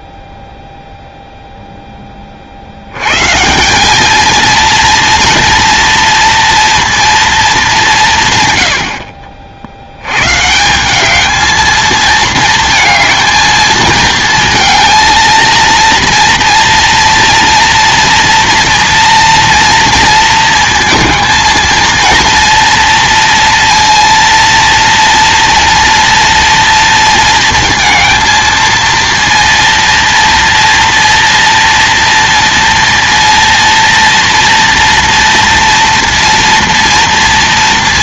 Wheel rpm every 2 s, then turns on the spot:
0, 90, 230, 230, 90, 180, 220, 230, 230, 230, 230, 230, 230, 230, 230, 230, 230, 230, 230.
none